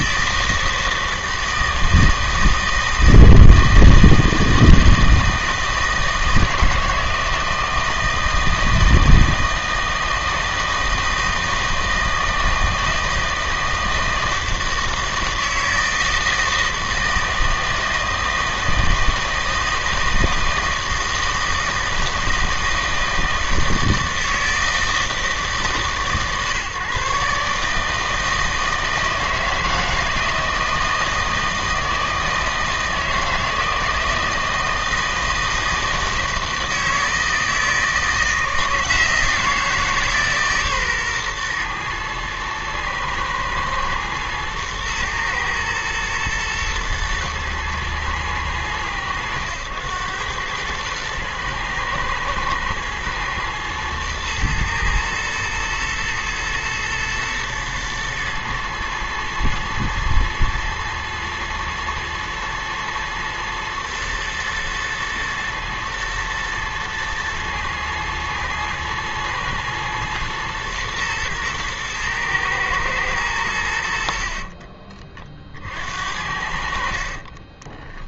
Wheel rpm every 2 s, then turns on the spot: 160, 160, 160, 160, 160, 160, 160, 160, 160, 160, 160, 160, 160, 140, 160, 160, 160, 160, 160, 160, 140, 110, 110, 110, 110, 110, 110, 110, 110, 120, 120, 110, 120, 120, 110, 120, 110, 30, 60.
74-76